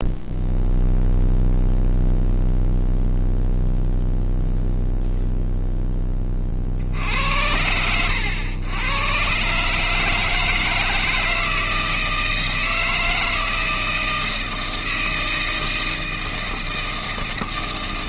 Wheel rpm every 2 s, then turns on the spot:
0, 0, 0, 30, 100, 150, 160, 160, 160.
none